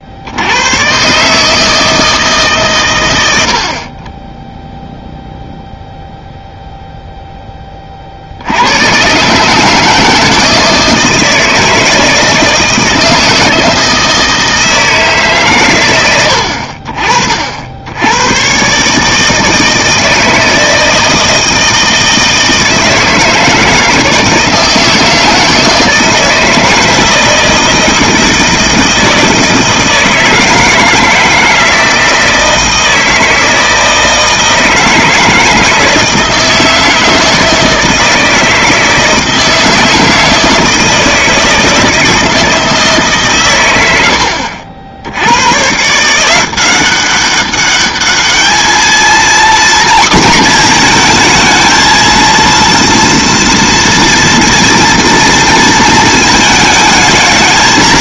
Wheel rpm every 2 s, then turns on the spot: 90, 140, 0, 0, 90, 160, 160, 160, 50, 130, 160, 160, 160, 160, 160, 160, 160, 160, 160, 160, 160, 160, 70, 180, 220, 230, 230, 230, 220.
none